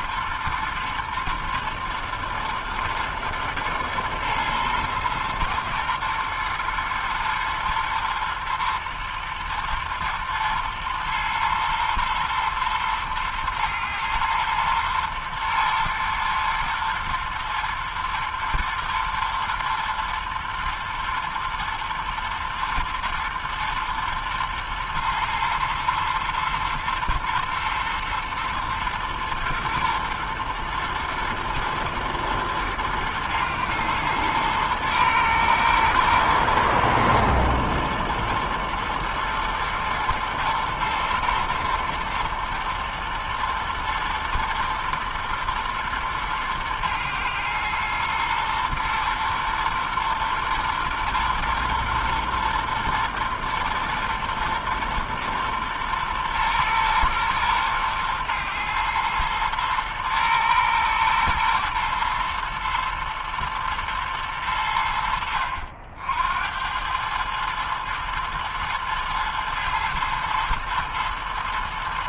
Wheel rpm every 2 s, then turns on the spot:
110, 120, 120, 120, 110, 110, 110, 120, 120, 110, 110, 110, 120, 110, 110, 120, 110, 120, 120, 110, 110, 110, 120, 110, 120, 120, 120, 120, 120, 120, 110, 110, 100, 70, 110, 110.
none